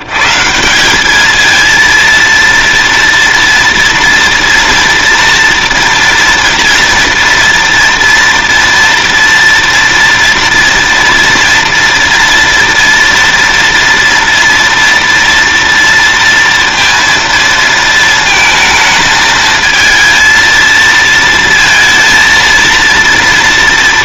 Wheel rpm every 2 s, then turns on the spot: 90, 230, 230, 230, 230, 230, 230, 230, 230, 220, 230, 230.
none